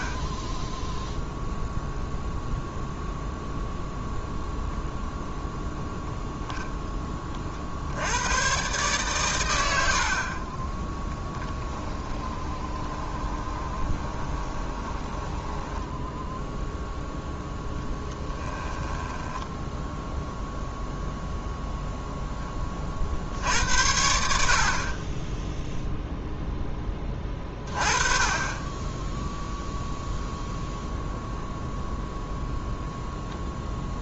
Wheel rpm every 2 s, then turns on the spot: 20, 0, 0, 0, 120, 20, 20, 20, 0, 10, 0, 20, 30, 0, 20, 0, 0.
10-16 18-20